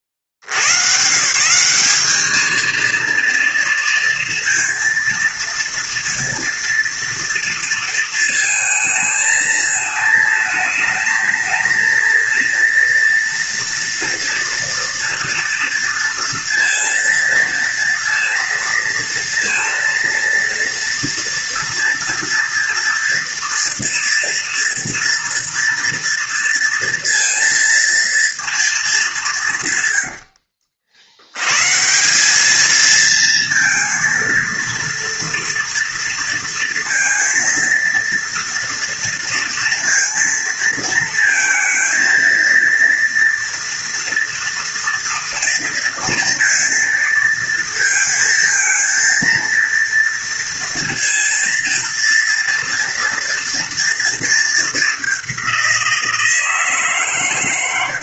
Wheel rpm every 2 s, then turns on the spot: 50, 220, 230, 230, 220, 220, 230, 240, 230, 230, 230, 230, 230, 230, 230, 70, 210, 230, 230, 230, 230, 230, 230, 230, 230, 230, 230, 220, 160.
30-32